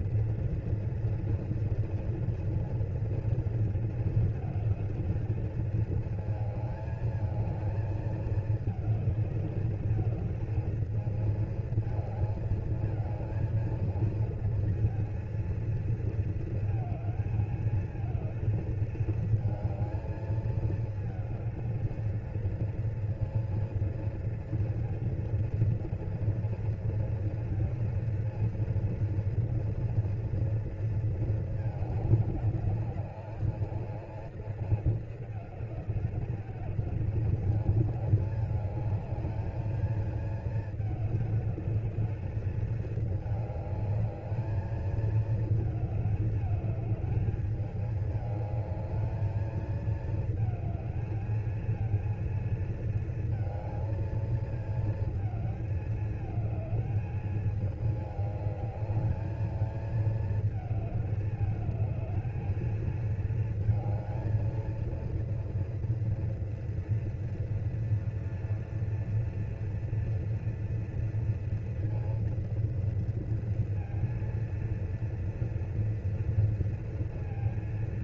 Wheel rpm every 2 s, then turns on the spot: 230, 230, 220, 220, 220, 220, 220, 230, 220, 220, 220, 220, 230, 230, 230, 230, 210, 230, 210, 210, 220, 210, 220, 210, 210, 220, 220, 220, 220, 210, 220, 220, 230, 230, 230, 230, 230, 230, 230.
none